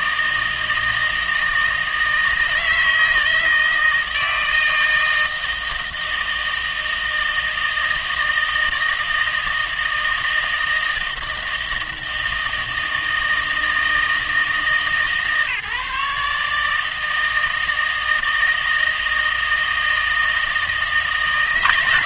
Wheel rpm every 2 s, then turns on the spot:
160, 160, 160, 160, 160, 160, 160, 160, 150, 160, 160.
none